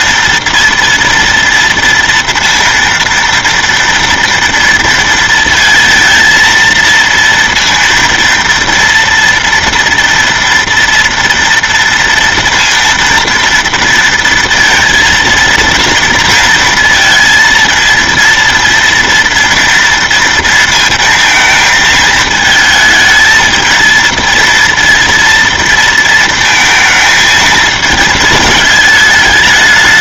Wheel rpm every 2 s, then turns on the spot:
230, 230, 230, 230, 230, 230, 230, 230, 230, 230, 230, 220, 230, 220, 220.
none